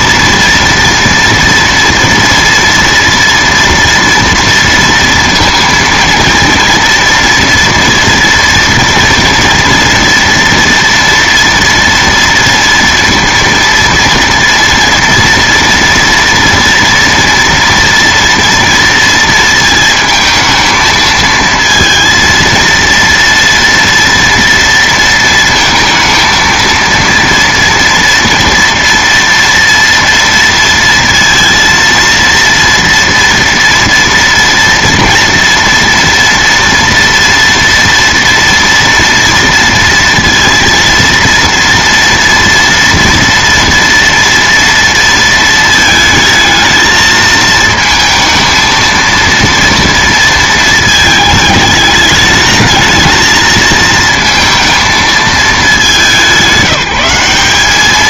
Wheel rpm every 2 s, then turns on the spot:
230, 230, 230, 230, 230, 230, 230, 230, 240, 230, 220, 230, 230, 230, 230, 230, 230, 230, 230, 230, 230, 230, 230, 220, 230, 220, 220, 220, 190.
none